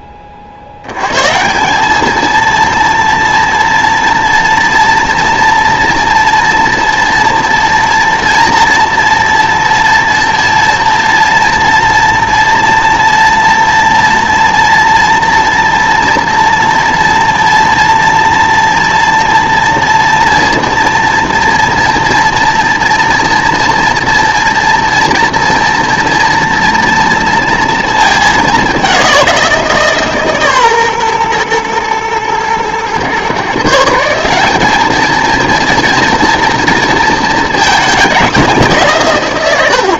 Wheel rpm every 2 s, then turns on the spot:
60, 230, 230, 230, 230, 230, 230, 240, 240, 240, 230, 240, 230, 230, 200, 140, 120, 200, 230, 170.
none